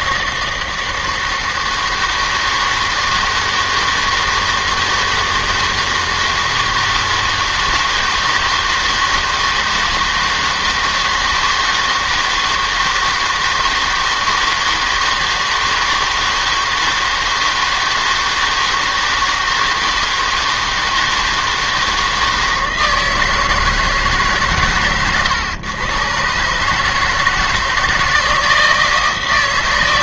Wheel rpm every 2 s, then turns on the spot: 160, 160, 160, 160, 160, 160, 160, 160, 160, 160, 160, 160, 140, 140, 160.
none